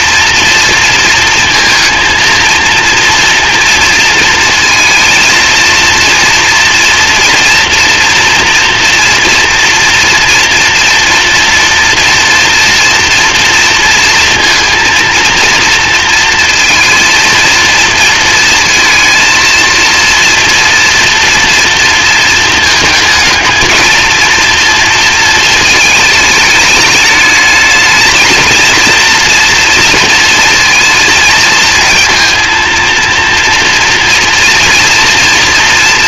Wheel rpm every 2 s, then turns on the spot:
230, 230, 230, 230, 230, 230, 230, 230, 230, 230, 240, 220, 230, 210, 230, 220, 230, 230.
none